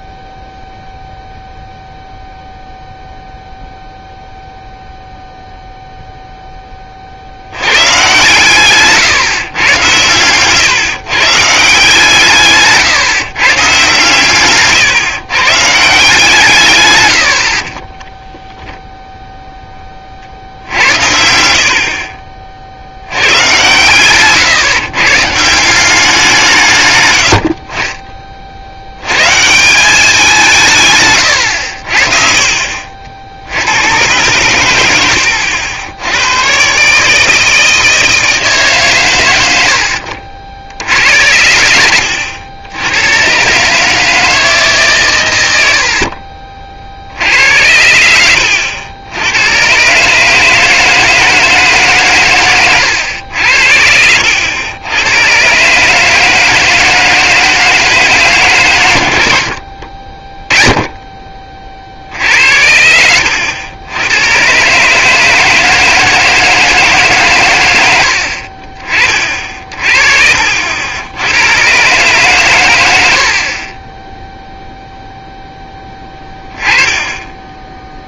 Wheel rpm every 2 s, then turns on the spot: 0, 0, 0, 20, 140, 130, 140, 130, 130, 0, 70, 60, 130, 120, 80, 160, 50, 100, 130, 140, 70, 90, 140, 60, 80, 160, 110, 90, 160, 120, 20, 80, 130, 160, 40, 70, 110, 0, 20.
14-16 20-22 52-54